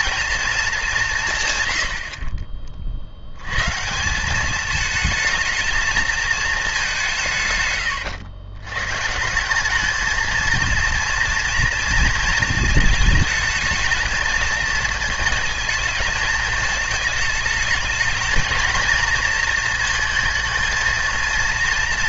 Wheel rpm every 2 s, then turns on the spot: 210, 40, 210, 200, 110, 230, 220, 220, 220, 230, 230.
none